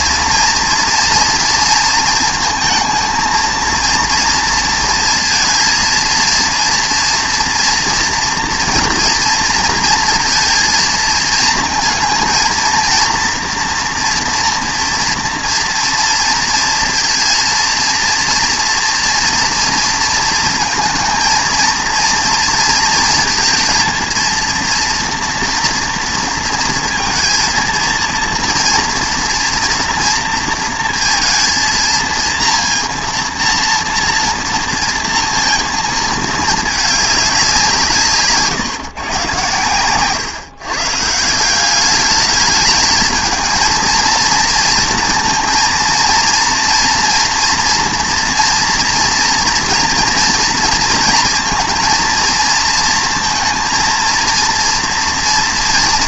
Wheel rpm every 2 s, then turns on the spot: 230, 220, 230, 230, 240, 230, 230, 230, 230, 230, 220, 230, 230, 230, 230, 230, 230, 230, 220, 150, 140, 220, 230, 230, 230, 230, 230, 230.
none